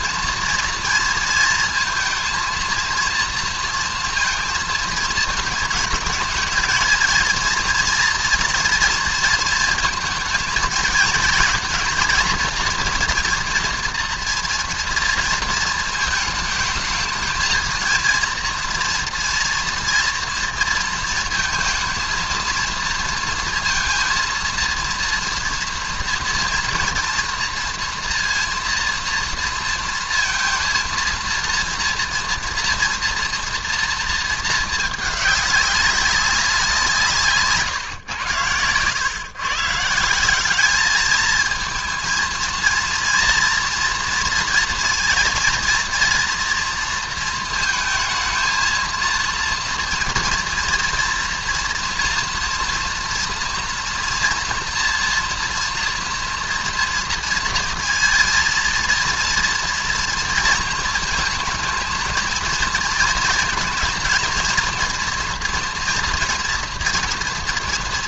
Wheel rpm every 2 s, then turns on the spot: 230, 230, 220, 220, 230, 230, 230, 240, 210, 230, 230, 230, 230, 230, 230, 230, 230, 220, 170, 110, 210, 230, 230, 230, 220, 230, 230, 230, 230, 230, 220, 220, 240, 240.
none